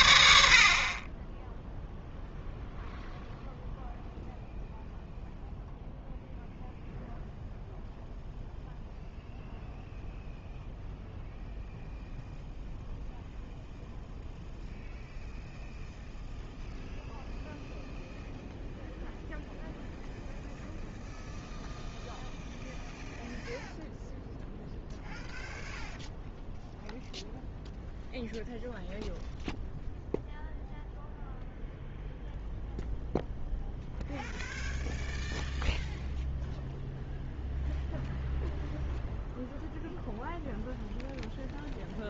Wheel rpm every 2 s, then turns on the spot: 40, 0, 0, 0, 0, 0, 0, 0, 0, 0, 0, 0, 0, 0, 0, 0, 0, 0, 0, 0, 0.
none